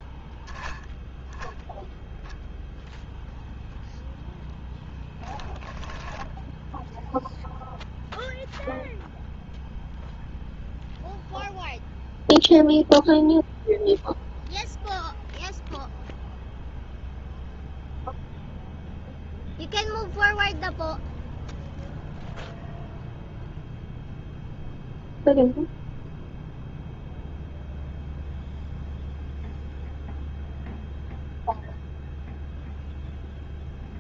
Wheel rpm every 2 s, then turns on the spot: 0, 0, 10, 0, 0, 0, 0, 0, 0, 0, 0, 0, 0, 0, 0, 0, 0.
none